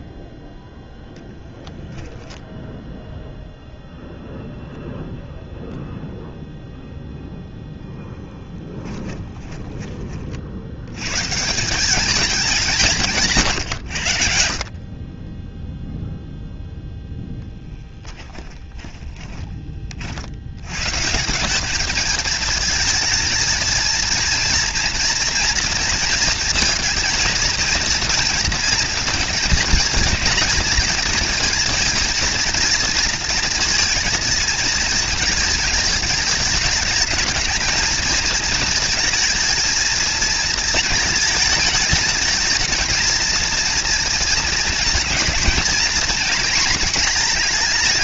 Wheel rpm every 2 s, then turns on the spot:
0, 0, 0, 0, 20, 110, 160, 40, 0, 20, 130, 220, 230, 230, 230, 220, 220, 230, 210, 230, 220, 220, 230, 230.
8-10 18-20